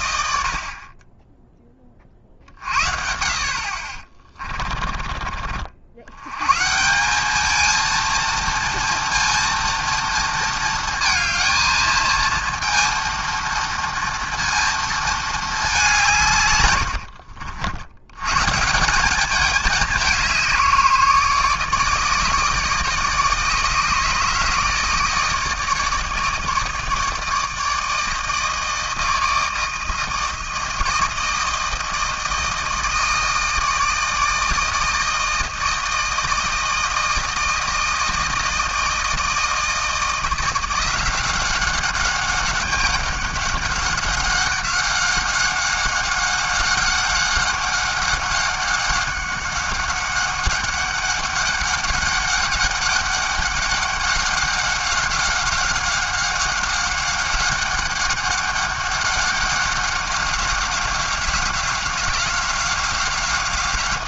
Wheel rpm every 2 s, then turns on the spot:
40, 60, 20, 170, 230, 230, 230, 230, 90, 180, 160, 150, 160, 150, 160, 160, 160, 160, 160, 160, 180, 190, 190, 190, 190, 200, 200, 190, 190, 200, 190, 190.
none